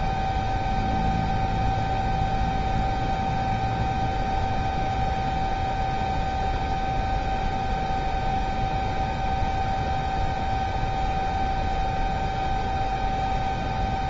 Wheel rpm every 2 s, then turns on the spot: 0, 0, 0, 0, 0, 0, 0.
none